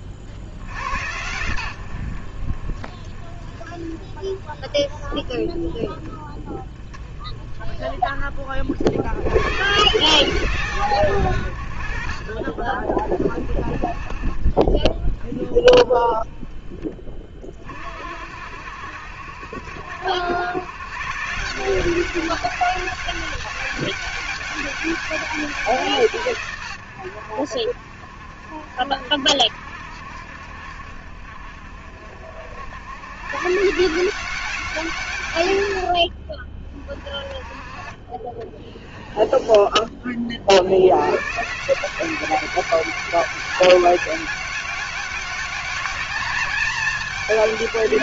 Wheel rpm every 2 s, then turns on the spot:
80, 30, 20, 20, 80, 120, 40, 10, 20, 60, 130, 200, 200, 90, 70, 60, 110, 160, 30, 20, 90, 200, 190, 210.
38-40